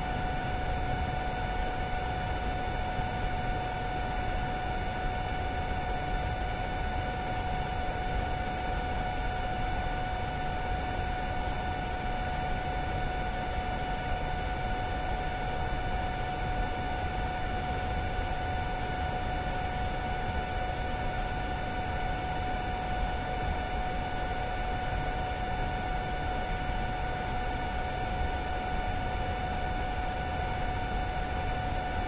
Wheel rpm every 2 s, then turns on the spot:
0, 0, 0, 0, 0, 0, 0, 0, 0, 0, 0, 0, 0, 0, 0, 0.
none